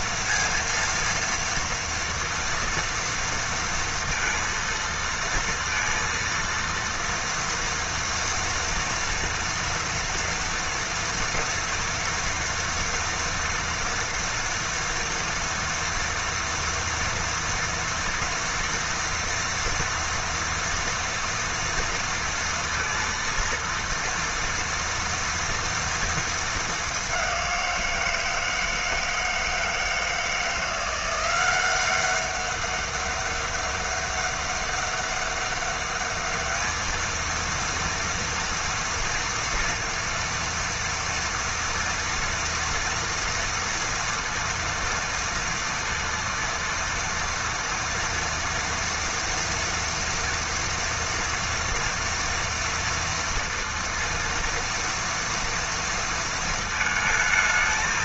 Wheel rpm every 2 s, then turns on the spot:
230, 230, 230, 230, 240, 230, 230, 230, 230, 230, 230, 230, 240, 210, 160, 170, 200, 200, 220, 230, 230, 230, 230, 230, 230, 240, 230, 230, 220.
none